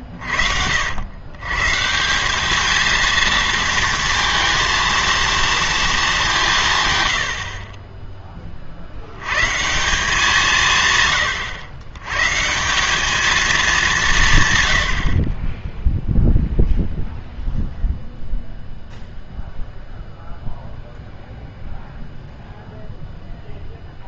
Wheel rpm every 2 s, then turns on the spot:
70, 220, 230, 150, 50, 160, 180, 100, 0, 0, 0, 0.
none